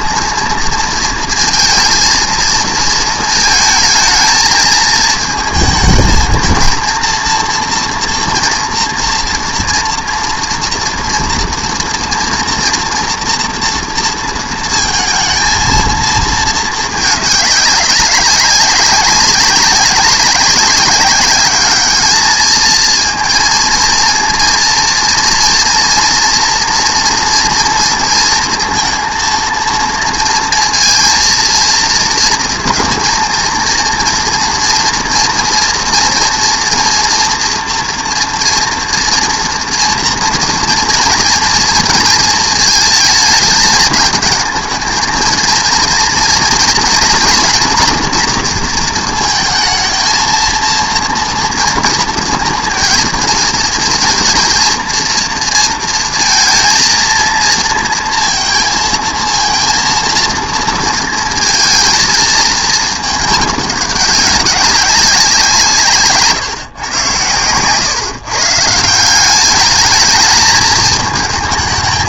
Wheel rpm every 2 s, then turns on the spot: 230, 220, 220, 220, 230, 230, 230, 230, 220, 190, 200, 220, 230, 230, 230, 230, 230, 230, 230, 230, 230, 230, 220, 240, 230, 230, 230, 230, 230, 230, 230, 220, 200, 130, 150, 220.
none